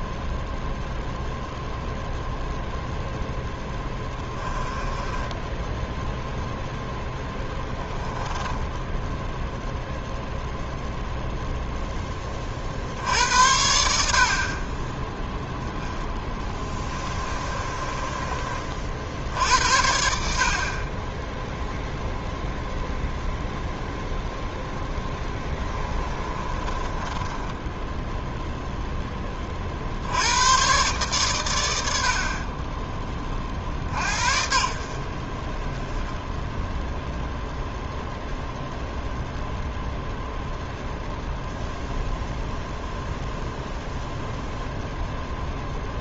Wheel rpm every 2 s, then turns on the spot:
0, 0, 10, 0, 10, 0, 50, 30, 20, 50, 30, 0, 10, 20, 0, 120, 20, 50, 0, 0, 0, 0, 0.
4-6 8-10 16-18 24-28